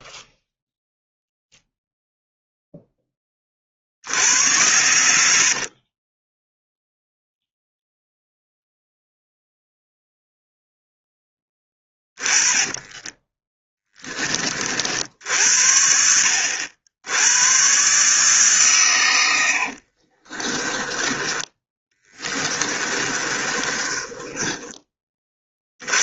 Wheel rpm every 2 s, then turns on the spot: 0, 10, 90, 0, 0, 0, 10, 60, 80, 120, 20, 30, 20.
12-14 20-24